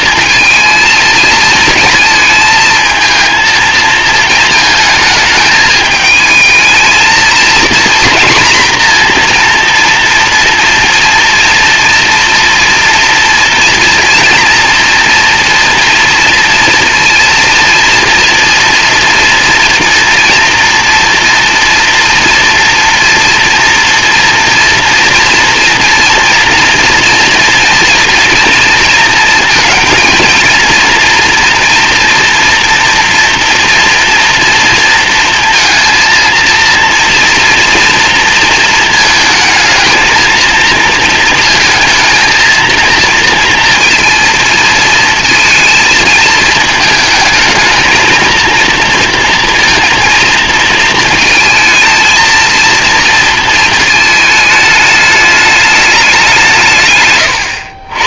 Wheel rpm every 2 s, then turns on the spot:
230, 220, 220, 220, 230, 230, 230, 230, 230, 230, 230, 230, 230, 230, 230, 230, 240, 230, 230, 230, 230, 230, 230, 220, 230, 220, 230, 210, 140.
none